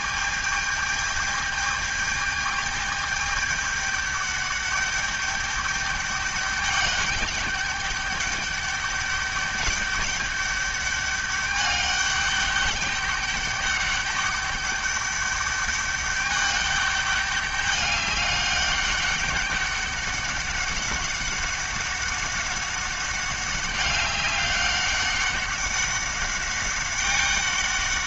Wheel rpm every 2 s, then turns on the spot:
210, 210, 200, 200, 200, 200, 200, 200, 200, 200, 200, 190, 190, 200.
none